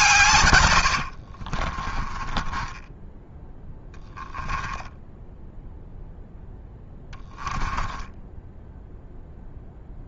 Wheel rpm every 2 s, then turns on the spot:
90, 20, 10, 10, 0.
0-8